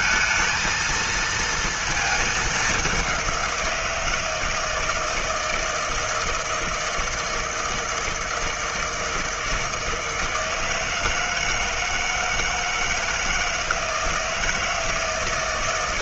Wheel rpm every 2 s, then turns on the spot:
230, 210, 160, 160, 160, 160, 160, 160.
none